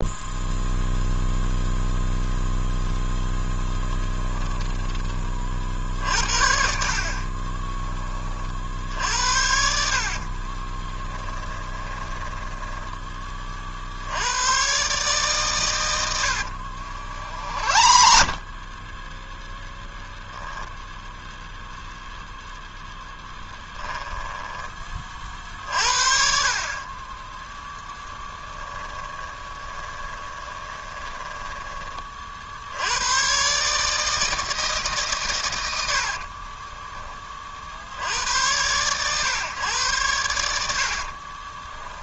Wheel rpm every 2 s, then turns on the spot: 0, 0, 20, 50, 60, 30, 10, 130, 70, 20, 0, 0, 20, 40, 10, 20, 80, 150, 20, 110, 70.
4-6 8-14 16-18 28-32 36-38 40-42